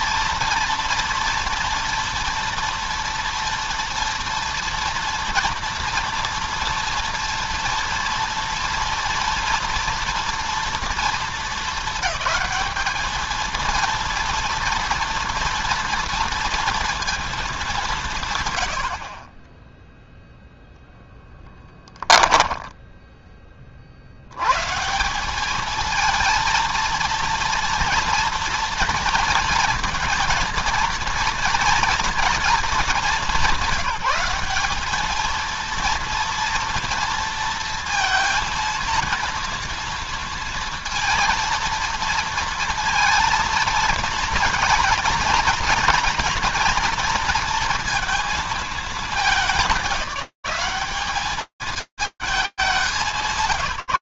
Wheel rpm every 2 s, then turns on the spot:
230, 230, 230, 230, 230, 240, 220, 230, 230, 120, 0, 10, 130, 230, 230, 230, 220, 200, 240, 230, 230, 230, 230, 240, 220, 200, 160.
22-24